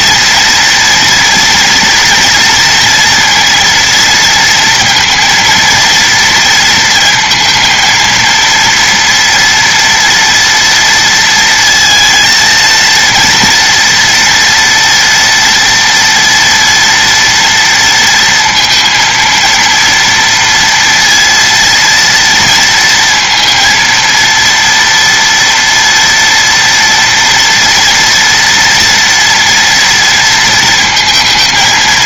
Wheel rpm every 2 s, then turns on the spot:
230, 230, 230, 230, 230, 230, 230, 230, 240, 230, 230, 230, 230, 240, 230, 230.
none